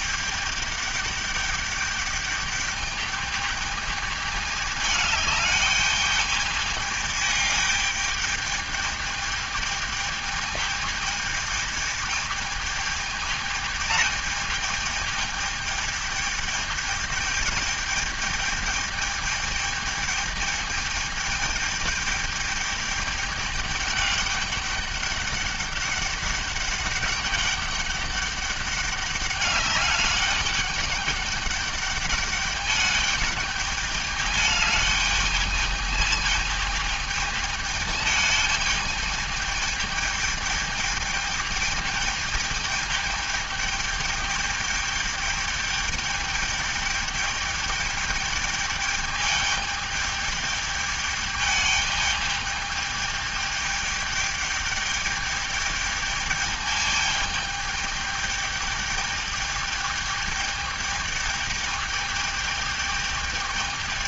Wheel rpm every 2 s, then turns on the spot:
210, 210, 210, 210, 210, 210, 210, 210, 220, 220, 210, 210, 200, 200, 200, 200, 210, 210, 220, 220, 210, 210, 210, 210, 210, 210, 210, 210, 210, 210, 210, 210.
none